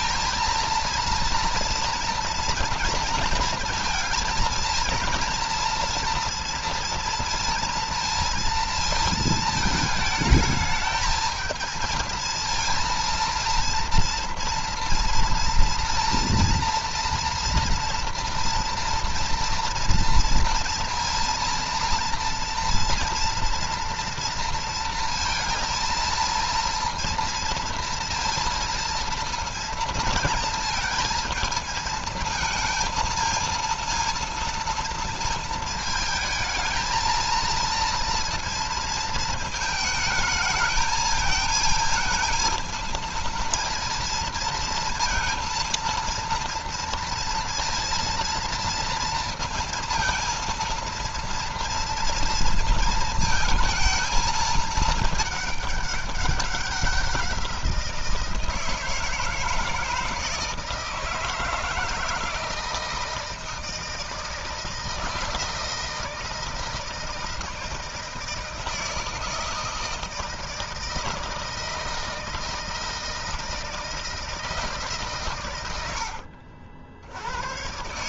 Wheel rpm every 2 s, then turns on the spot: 230, 230, 230, 230, 230, 220, 230, 230, 230, 230, 230, 230, 230, 230, 230, 230, 220, 230, 220, 230, 220, 230, 230, 230, 230, 230, 230, 220, 190, 160, 160, 160, 160, 160, 160, 160, 160, 150, 70.
none